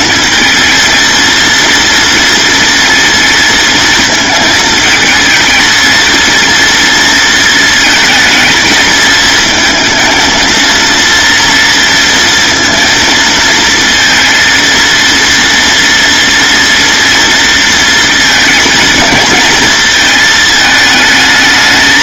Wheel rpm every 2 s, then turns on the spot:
230, 230, 220, 230, 230, 230, 230, 230, 230, 230, 220.
none